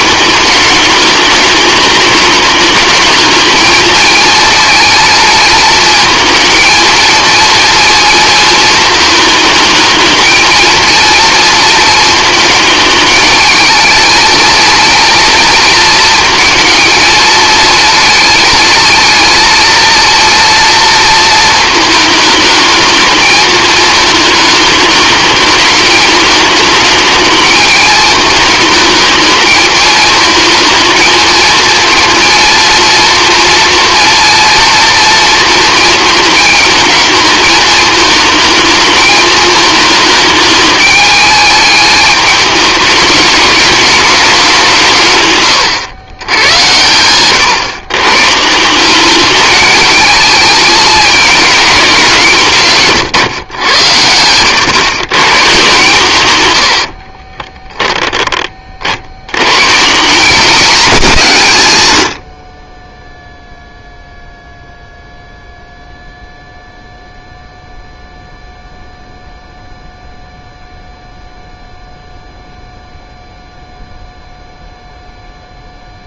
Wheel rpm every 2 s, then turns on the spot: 210, 210, 230, 220, 230, 230, 220, 230, 230, 230, 230, 220, 210, 210, 220, 230, 230, 230, 220, 220, 210, 210, 160, 100, 190, 220, 140, 110, 80, 60, 240, 10, 0, 0, 0, 0, 0, 0.
46-48 56-58